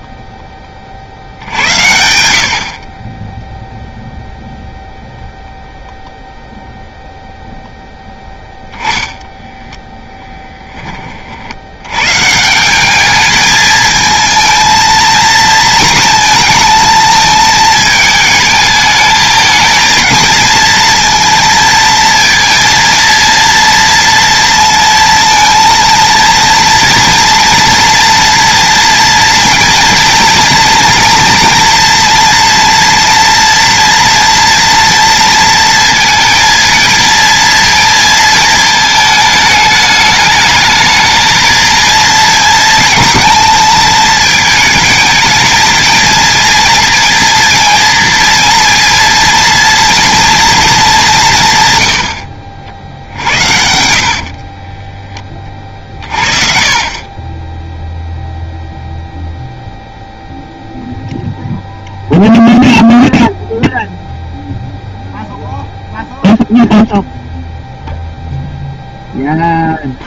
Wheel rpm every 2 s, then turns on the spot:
30, 50, 0, 0, 0, 20, 190, 230, 220, 220, 230, 230, 230, 230, 230, 230, 230, 230, 230, 220, 220, 220, 220, 230, 230, 210, 60, 20, 40, 0, 0, 0, 0, 0, 0.
2-4 54-56